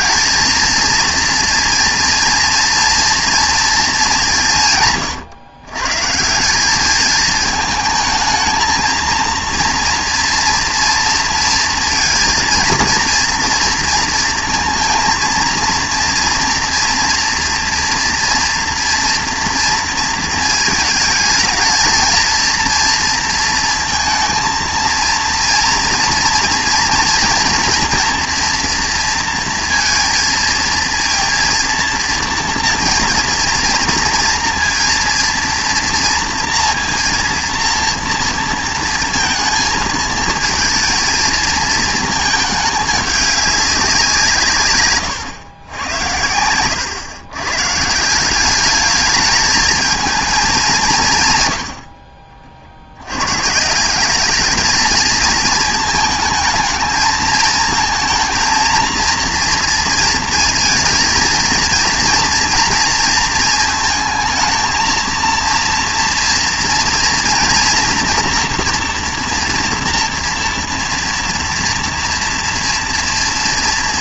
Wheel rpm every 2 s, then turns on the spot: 220, 230, 160, 200, 220, 230, 230, 230, 230, 230, 220, 230, 230, 230, 230, 230, 240, 230, 230, 230, 220, 210, 140, 100, 200, 200, 50, 210, 220, 230, 230, 230, 220, 240, 240, 230, 230.
none